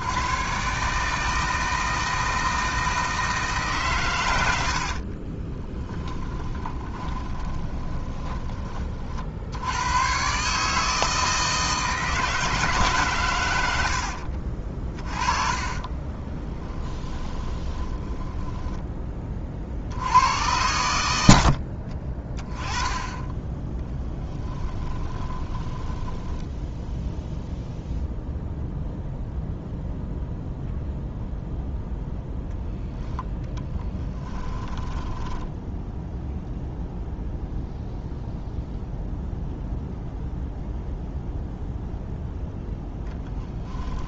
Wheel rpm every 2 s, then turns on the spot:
140, 160, 60, 20, 30, 150, 150, 40, 10, 10, 100, 10, 20, 10, 0, 0, 0, 10, 0, 0, 0, 0.
4-8 14-18 24-28 34-36